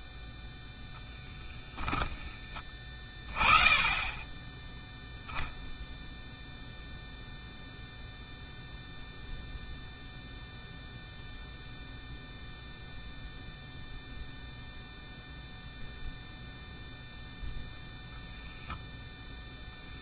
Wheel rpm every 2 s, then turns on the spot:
10, 10, 0, 0, 0, 0, 0, 0, 0, 0.
0-2